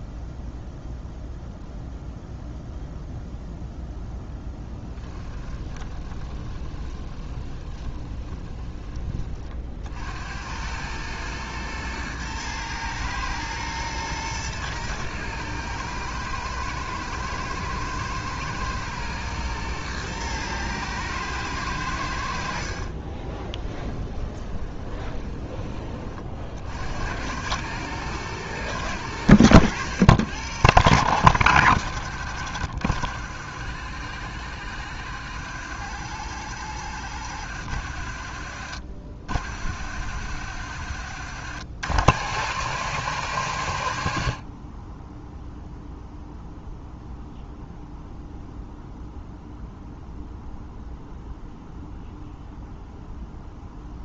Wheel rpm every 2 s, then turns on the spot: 0, 0, 10, 20, 20, 100, 110, 110, 110, 120, 110, 50, 20, 70, 100, 110, 70, 80, 90, 60, 80, 120, 20, 0, 0, 0, 0.
4-8 22-26